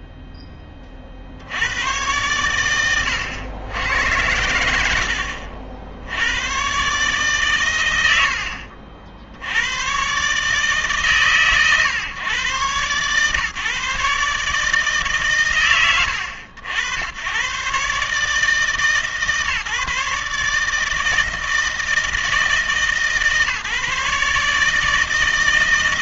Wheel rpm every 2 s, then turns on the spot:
10, 110, 70, 110, 60, 150, 120, 150, 80, 150, 150, 150, 150.
none